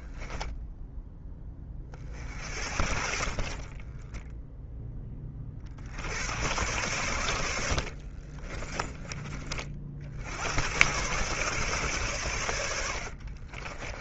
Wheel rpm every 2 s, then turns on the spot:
10, 60, 10, 100, 30, 110, 90.
2-4 8-10 12-14